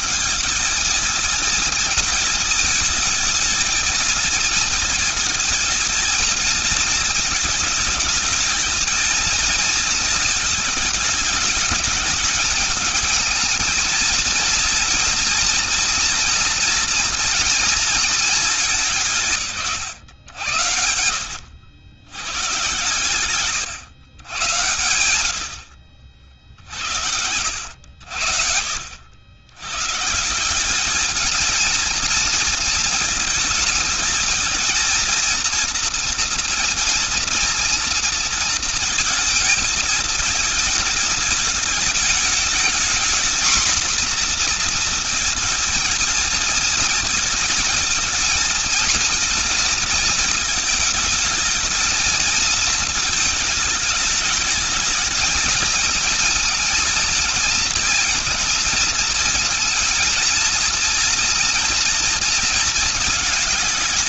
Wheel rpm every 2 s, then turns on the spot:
210, 220, 220, 230, 220, 220, 220, 230, 230, 200, 80, 110, 110, 70, 80, 190, 220, 230, 230, 230, 220, 220, 230, 230, 230, 220, 220, 210, 230, 230, 230, 230.
none